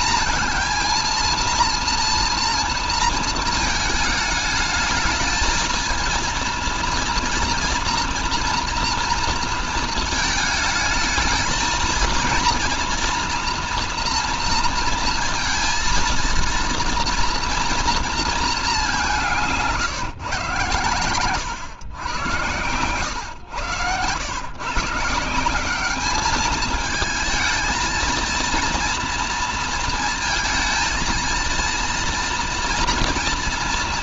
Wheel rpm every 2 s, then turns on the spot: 230, 230, 210, 230, 230, 220, 230, 230, 230, 210, 130, 120, 140, 210, 230, 230, 240.
22-24